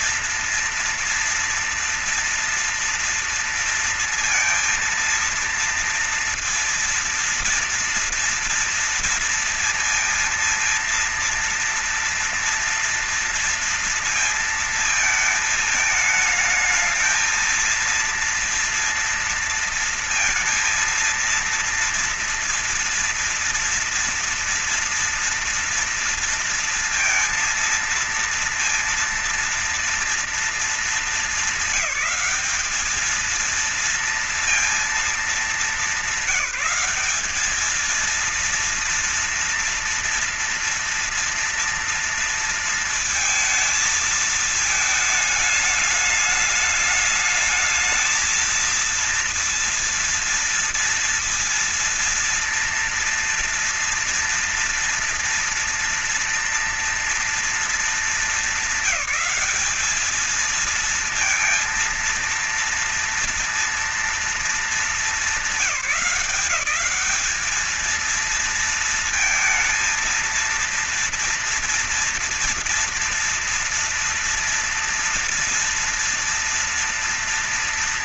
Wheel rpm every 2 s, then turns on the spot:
230, 230, 230, 230, 230, 230, 230, 230, 220, 230, 230, 230, 230, 230, 230, 230, 200, 230, 190, 230, 230, 230, 220, 210, 220, 230, 240, 240, 230, 220, 220, 230, 210, 190, 230, 230, 230, 240, 230.
none